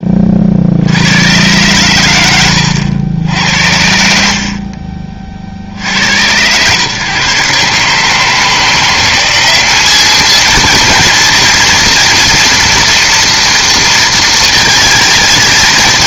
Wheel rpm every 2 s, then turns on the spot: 50, 90, 50, 110, 170, 230, 230, 230.
2-4